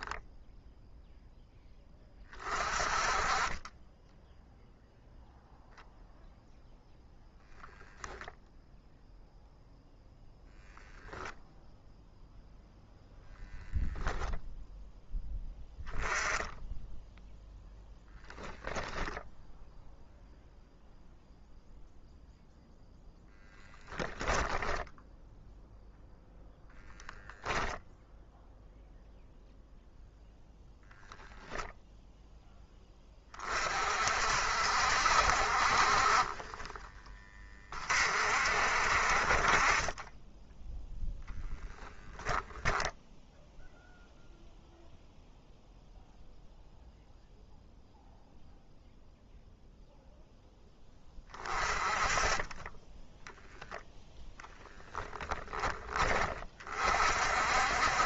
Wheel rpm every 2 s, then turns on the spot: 0, 30, 0, 0, 0, 10, 0, 0, 10, 0, 0, 0, 0, 0, 0, 0, 10, 60, 20, 50, 10, 10, 0, 0, 0, 10, 10, 10, 50.
10-12